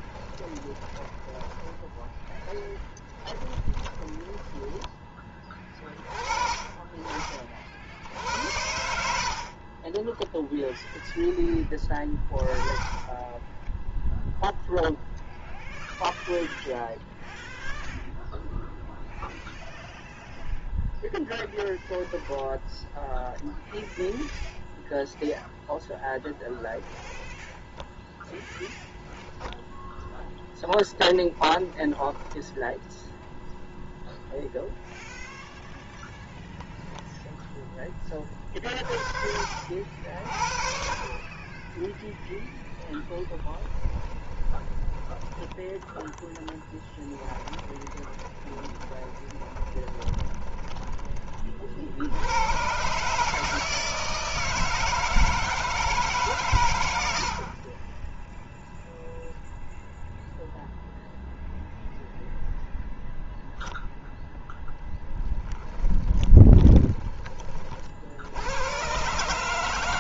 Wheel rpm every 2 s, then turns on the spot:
20, 10, 10, 30, 80, 0, 20, 0, 0, 0, 0, 0, 0, 0, 10, 10, 0, 0, 0, 40, 50, 0, 20, 10, 20, 20, 120, 160, 110, 0, 0, 0, 10, 20, 110.
0-4 46-52